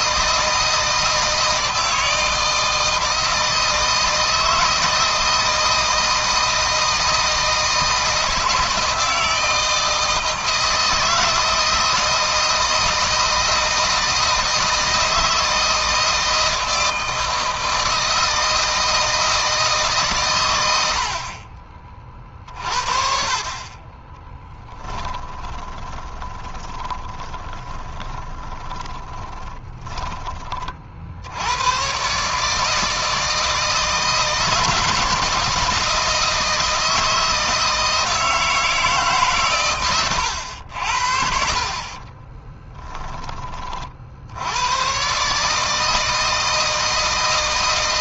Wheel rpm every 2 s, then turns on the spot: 160, 160, 160, 160, 160, 160, 160, 160, 160, 160, 90, 40, 10, 20, 20, 50, 150, 160, 160, 160, 80, 20, 110, 160.
24-30 42-44